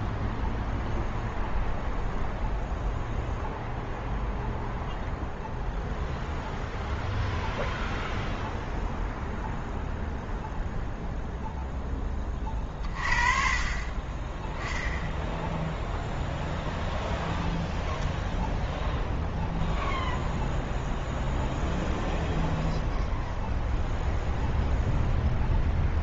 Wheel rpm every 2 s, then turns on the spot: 0, 0, 0, 0, 0, 0, 40, 10, 0, 0, 0, 0, 0.
none